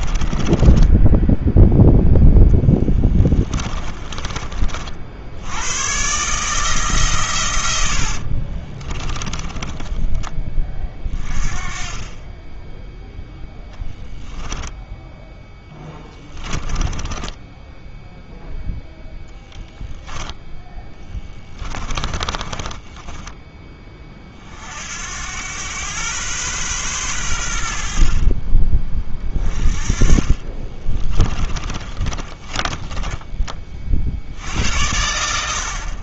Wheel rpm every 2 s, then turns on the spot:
20, 10, 50, 150, 30, 20, 10, 10, 10, 0, 10, 20, 60, 120, 30, 30, 20, 70.
0-4 8-10 16-18 20-24 30-34